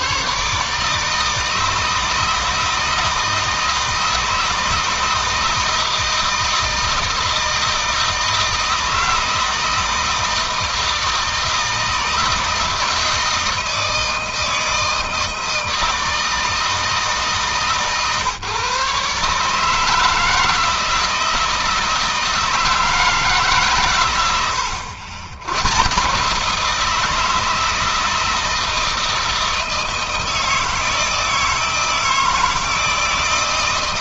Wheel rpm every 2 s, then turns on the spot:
150, 160, 160, 160, 160, 160, 160, 160, 160, 140, 160, 160, 90, 170, 160, 160, 160.
none